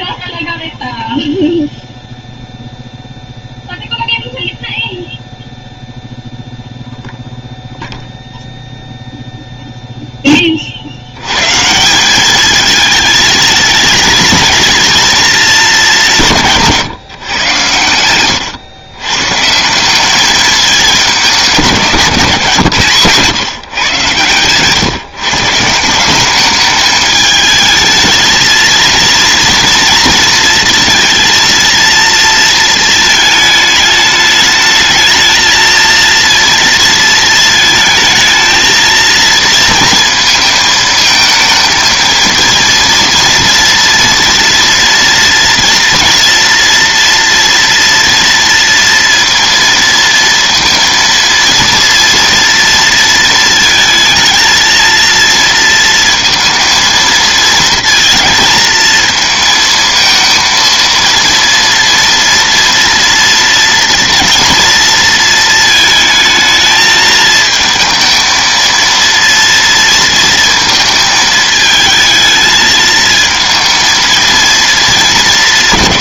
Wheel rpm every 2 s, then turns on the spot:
0, 0, 0, 0, 0, 120, 220, 220, 120, 140, 180, 130, 150, 220, 230, 230, 220, 220, 230, 220, 220, 230, 240, 230, 230, 230, 230, 230, 230, 220, 230, 230, 220, 220, 230, 220, 220, 200.
none